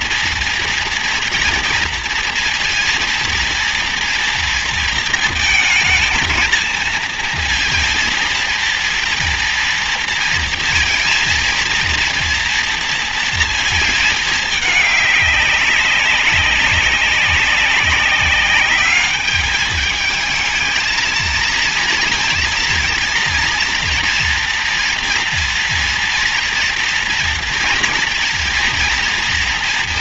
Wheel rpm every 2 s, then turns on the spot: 230, 230, 230, 230, 230, 230, 230, 210, 190, 200, 220, 230, 230, 230, 230.
none